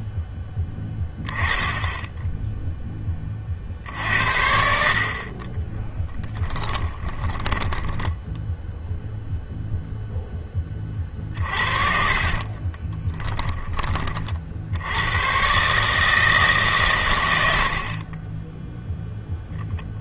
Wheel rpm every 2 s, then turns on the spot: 10, 10, 50, 10, 0, 30, 30, 80, 140, 0.
6-8 12-14